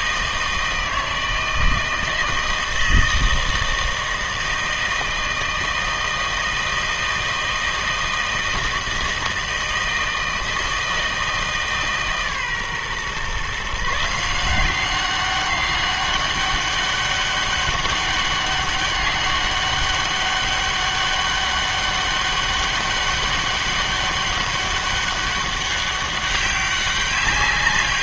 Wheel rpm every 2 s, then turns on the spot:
160, 160, 160, 160, 160, 160, 130, 180, 200, 200, 200, 200, 200, 200.
none